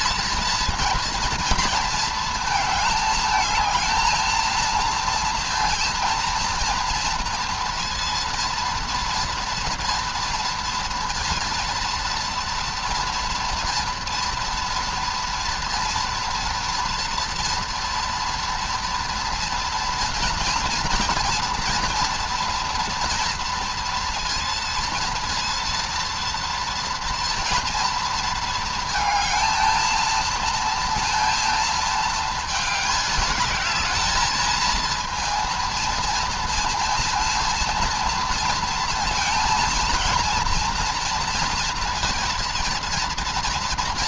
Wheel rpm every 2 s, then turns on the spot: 230, 220, 220, 230, 230, 230, 230, 230, 230, 230, 230, 240, 230, 230, 220, 230, 220, 220, 230, 230, 230, 230.
none